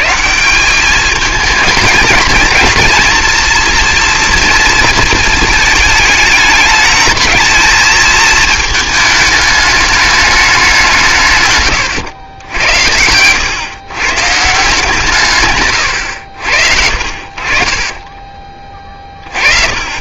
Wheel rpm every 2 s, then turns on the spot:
190, 220, 230, 220, 220, 190, 90, 150, 70, 30.
none